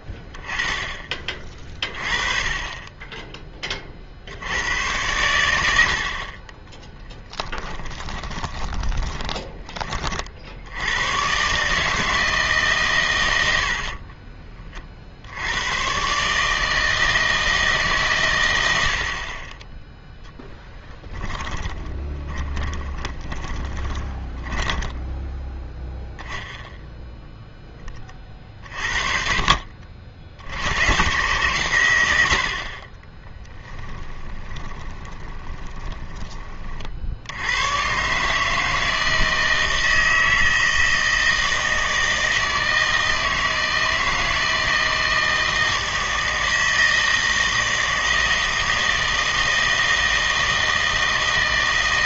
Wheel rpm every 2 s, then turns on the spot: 20, 20, 90, 30, 20, 60, 150, 30, 150, 80, 10, 20, 10, 0, 30, 80, 60, 20, 30, 160, 160, 160, 160, 160, 160, 160.
8-10 20-26 34-36